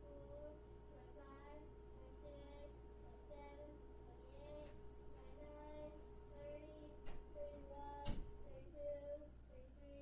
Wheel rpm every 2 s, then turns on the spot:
0, 0, 0, 0, 0.
none